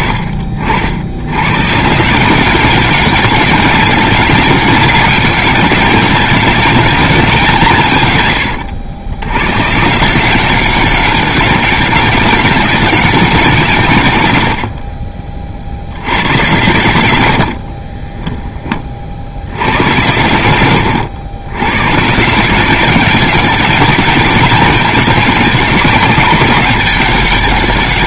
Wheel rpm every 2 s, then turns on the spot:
70, 190, 200, 200, 100, 190, 200, 60, 110, 20, 100, 200, 200, 190.
14-16